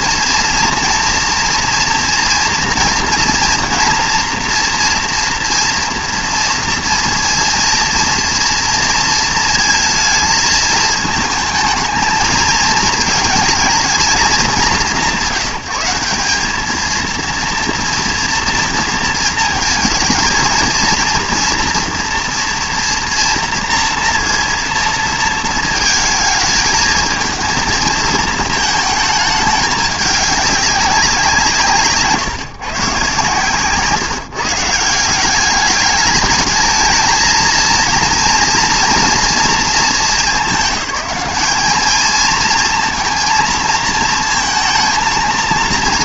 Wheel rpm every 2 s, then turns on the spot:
230, 230, 230, 230, 230, 220, 220, 170, 210, 230, 220, 230, 230, 220, 220, 200, 150, 180, 220, 230, 180, 230, 230.
none